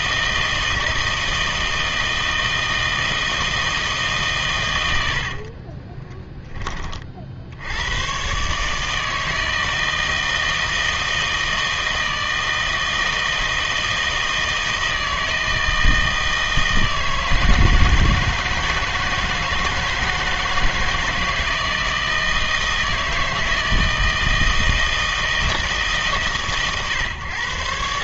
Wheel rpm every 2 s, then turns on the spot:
160, 160, 110, 30, 150, 160, 160, 160, 160, 160, 160, 160, 160, 120.
none